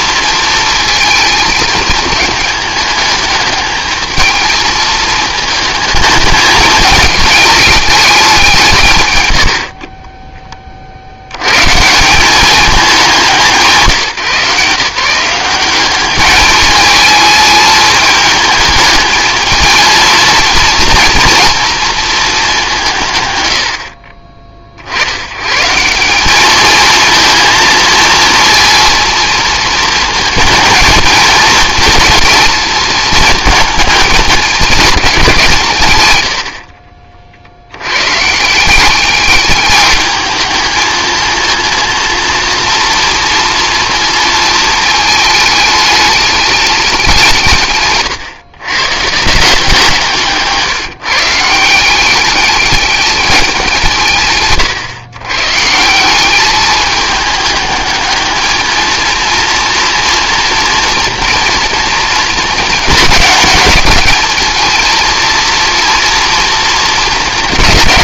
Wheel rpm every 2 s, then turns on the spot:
220, 220, 220, 210, 170, 20, 200, 150, 220, 220, 230, 200, 50, 220, 230, 220, 220, 210, 70, 170, 220, 230, 220, 200, 120, 160, 200, 140, 210, 220, 230, 220, 220, 230.
36-38